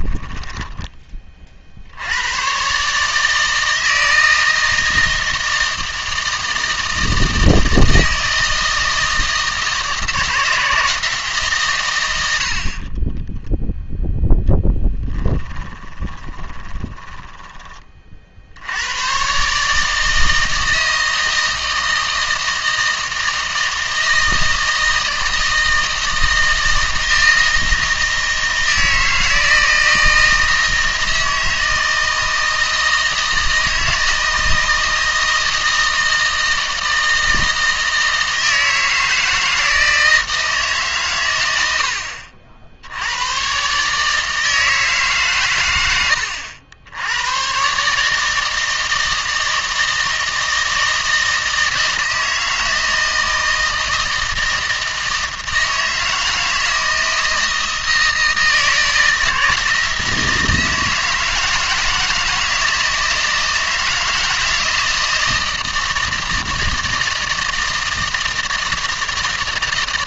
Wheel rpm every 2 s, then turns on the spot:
10, 130, 160, 160, 160, 160, 70, 10, 20, 80, 160, 160, 160, 160, 160, 160, 160, 160, 160, 160, 150, 70, 160, 80, 160, 160, 160, 160, 160, 160, 160, 160, 160, 160, 160.
14-18